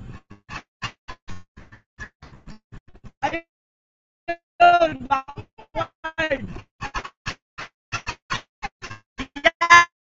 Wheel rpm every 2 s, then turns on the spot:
0, 0, 0, 50, 10.
none